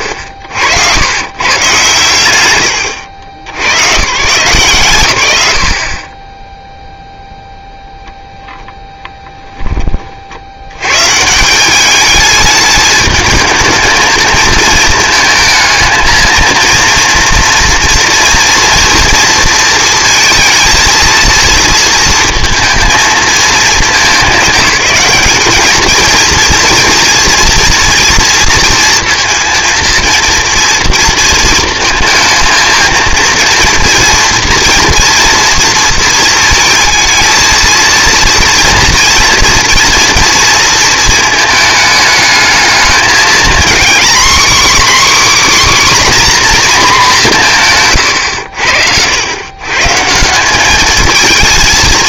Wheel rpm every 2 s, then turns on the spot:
80, 120, 140, 0, 0, 90, 210, 220, 230, 230, 230, 220, 200, 230, 230, 230, 220, 230, 220, 230, 230, 210, 260, 240, 80, 200.
48-50